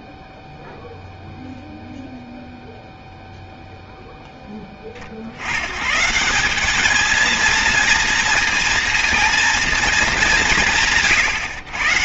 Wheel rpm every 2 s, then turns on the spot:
0, 0, 10, 190, 230, 190.
none